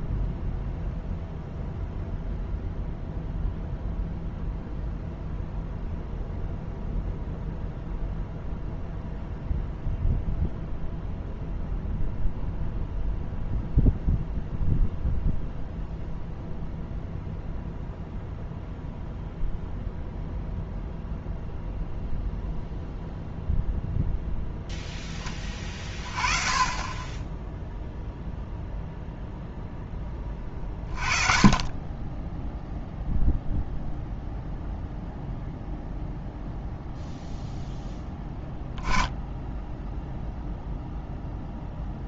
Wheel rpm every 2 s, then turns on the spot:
0, 0, 0, 0, 0, 0, 0, 0, 0, 0, 0, 0, 0, 20, 0, 30, 0, 0, 0, 10, 0.
none